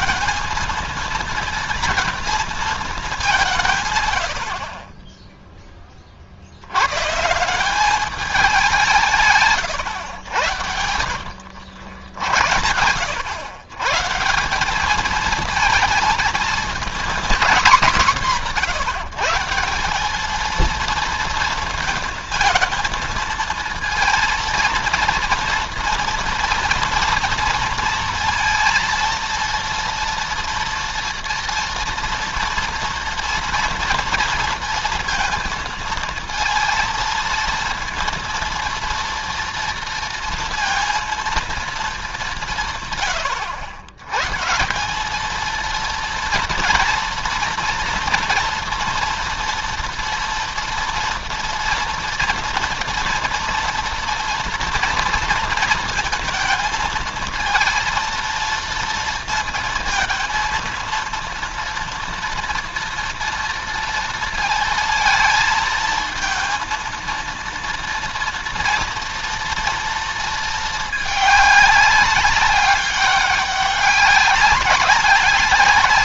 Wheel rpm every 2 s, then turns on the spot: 220, 230, 60, 90, 180, 80, 90, 190, 220, 170, 220, 230, 230, 230, 230, 230, 240, 230, 230, 230, 230, 170, 160, 240, 230, 230, 230, 240, 220, 230, 230, 230, 230, 230, 230, 220, 200, 190.
4-6